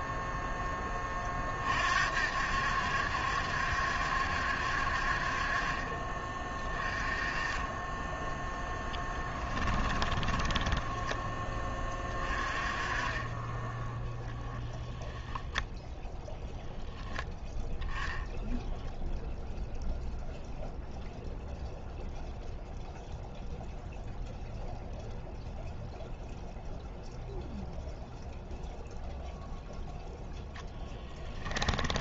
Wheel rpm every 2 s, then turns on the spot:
20, 70, 60, 20, 10, 10, 30, 0, 0, 0, 0, 0, 0, 0, 0, 0.
8-10